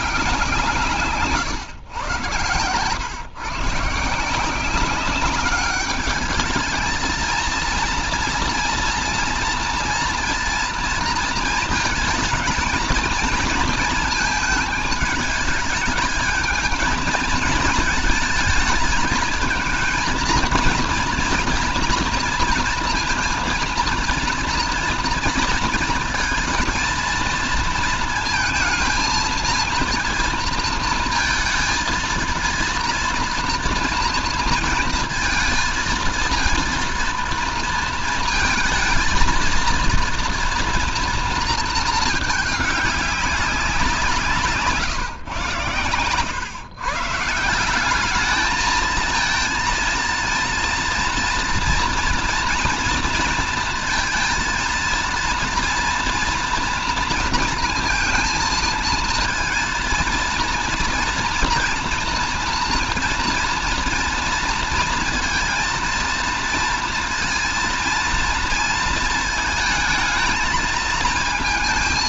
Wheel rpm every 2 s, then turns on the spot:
170, 120, 190, 220, 230, 230, 230, 210, 220, 220, 230, 230, 230, 230, 230, 230, 230, 230, 230, 230, 230, 200, 140, 140, 220, 230, 230, 230, 230, 220, 230, 230, 230, 230, 220, 220.
none